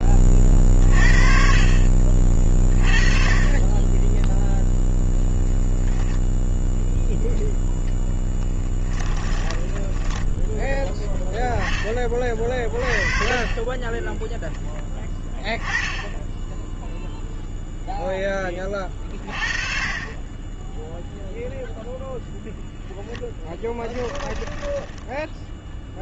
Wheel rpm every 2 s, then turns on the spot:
30, 30, 0, 0, 20, 10, 30, 10, 10, 20, 20, 0, 10.
8-10 24-26